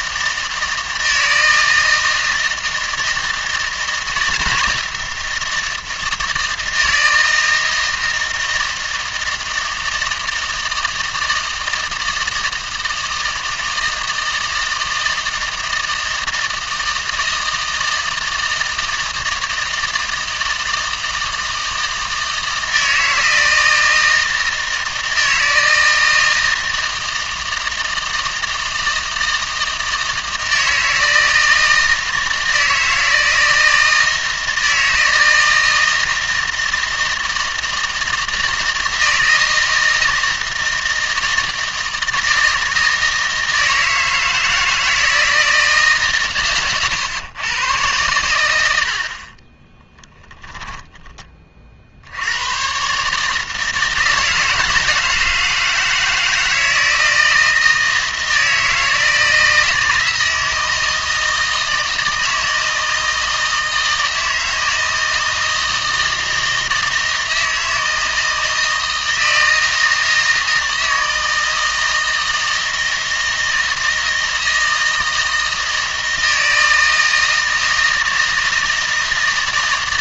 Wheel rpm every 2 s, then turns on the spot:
160, 160, 160, 160, 160, 160, 160, 160, 160, 160, 160, 160, 160, 160, 160, 160, 160, 160, 170, 160, 160, 160, 160, 120, 80, 10, 120, 160, 160, 160, 160, 160, 160, 160, 160, 160, 160, 160, 160, 160.
none